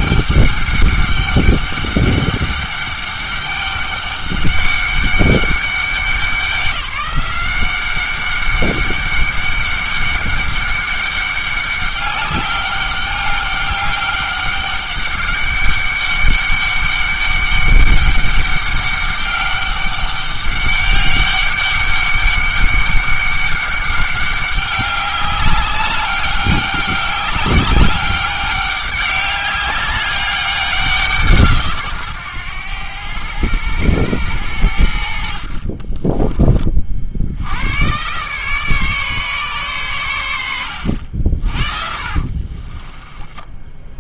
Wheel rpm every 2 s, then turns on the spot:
200, 200, 200, 180, 200, 200, 200, 200, 200, 200, 200, 200, 200, 200, 200, 190, 110, 80, 40, 150, 90, 30.
42-44